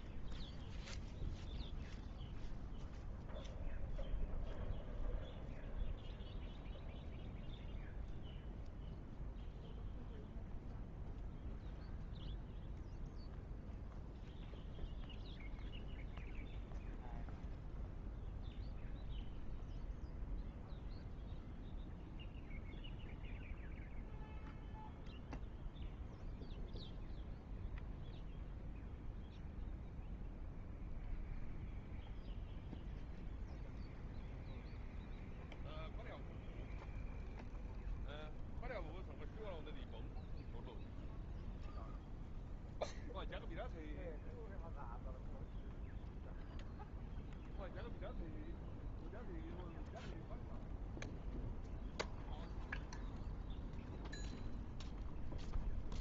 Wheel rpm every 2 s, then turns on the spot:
10, 0, 0, 0, 0, 0, 0, 0, 0, 0, 0, 0, 0, 0, 0, 0, 0, 0, 0, 0, 0, 0, 0, 0, 0, 0, 0, 0.
none